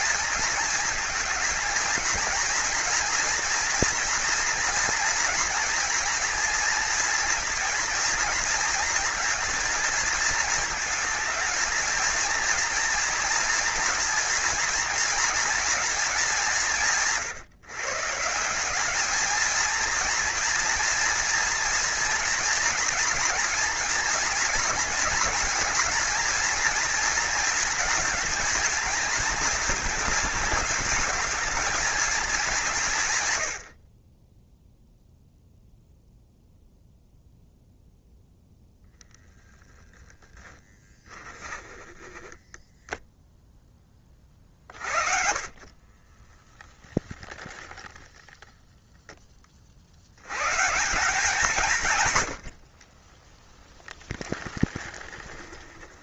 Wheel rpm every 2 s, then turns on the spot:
220, 230, 220, 230, 230, 230, 230, 230, 170, 200, 230, 230, 230, 230, 230, 220, 160, 0, 0, 0, 10, 0, 40, 0, 0, 160, 20, 10.
40-42 44-46 52-56